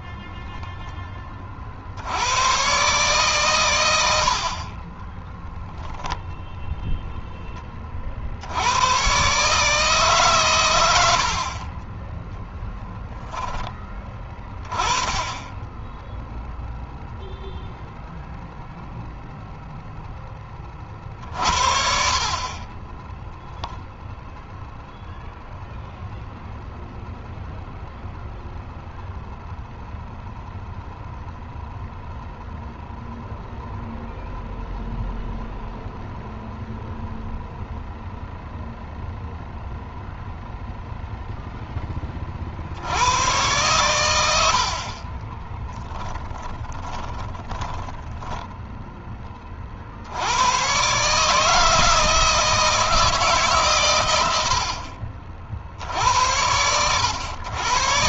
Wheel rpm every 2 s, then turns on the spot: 20, 130, 20, 0, 100, 100, 10, 20, 0, 0, 40, 20, 0, 0, 0, 0, 0, 0, 0, 0, 0, 70, 50, 20, 10, 120, 160, 60, 100.
0-2 4-6 12-14 46-48